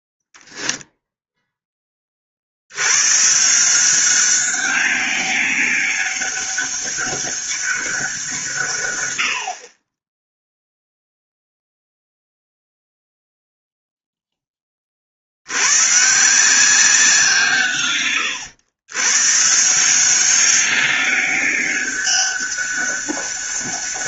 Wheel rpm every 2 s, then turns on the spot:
10, 100, 200, 200, 120, 0, 0, 40, 180, 120, 200, 200.
none